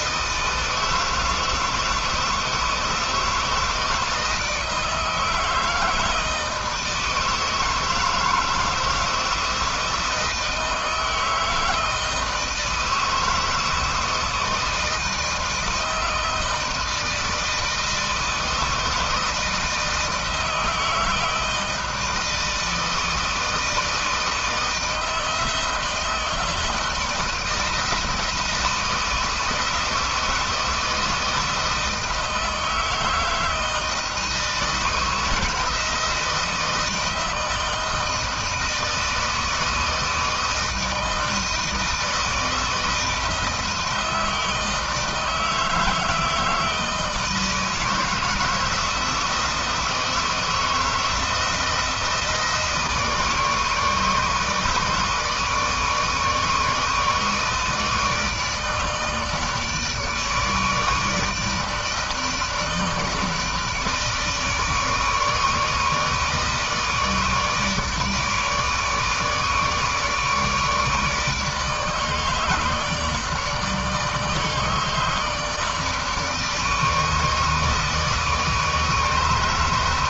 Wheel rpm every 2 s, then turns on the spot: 160, 160, 160, 160, 160, 160, 160, 160, 160, 160, 160, 160, 160, 160, 160, 160, 160, 160, 160, 160, 160, 160, 170, 160, 160, 160, 160, 150, 150, 160, 150, 160, 150, 150, 150, 160, 160, 160, 150, 160.
none